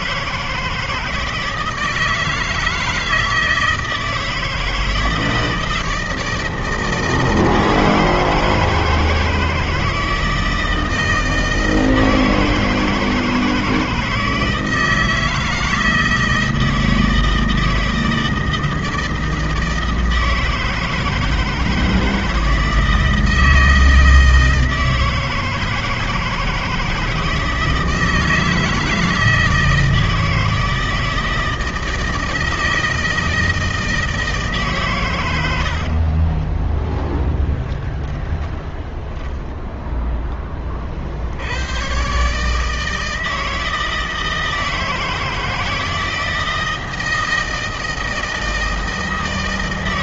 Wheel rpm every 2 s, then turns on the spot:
160, 160, 160, 160, 160, 160, 160, 160, 160, 160, 160, 160, 160, 160, 160, 160, 160, 150, 20, 30, 30, 150, 160, 160, 160.
36-40